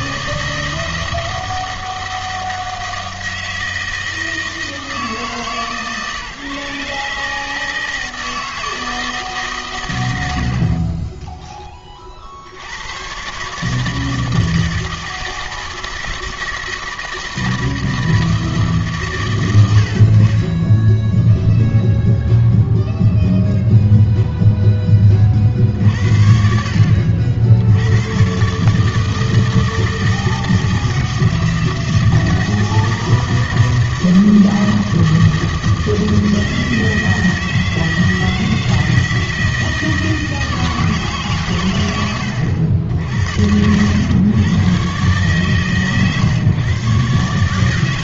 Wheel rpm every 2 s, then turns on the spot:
160, 160, 160, 150, 160, 50, 90, 160, 160, 150, 10, 0, 10, 60, 140, 160, 160, 160, 160, 160, 160, 80, 130, 130.
none